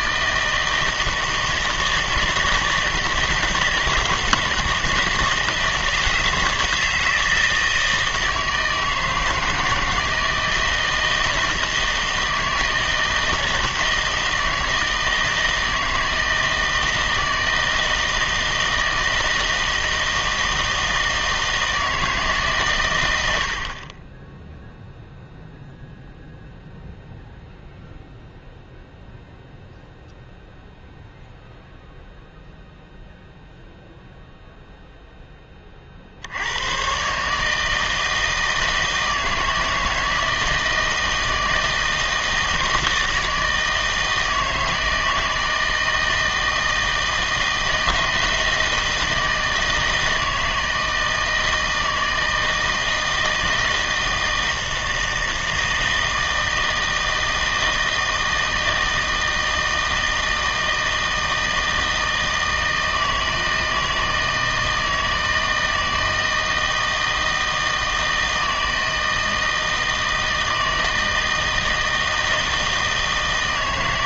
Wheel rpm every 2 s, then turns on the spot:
160, 160, 160, 160, 160, 160, 160, 160, 160, 160, 160, 140, 0, 0, 0, 0, 0, 0, 100, 160, 160, 160, 160, 160, 160, 160, 160, 160, 160, 160, 160, 160, 160, 160, 160, 160, 160.
none